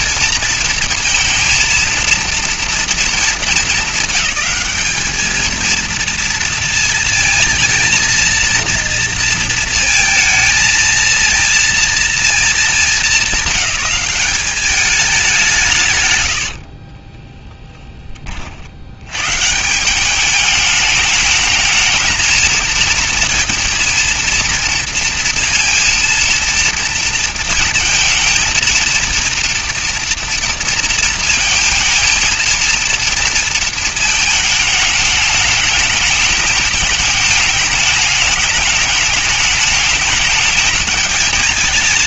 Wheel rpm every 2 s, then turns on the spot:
230, 230, 210, 230, 230, 230, 200, 200, 30, 110, 210, 230, 230, 230, 230, 230, 230, 210, 210, 210, 220.
16-18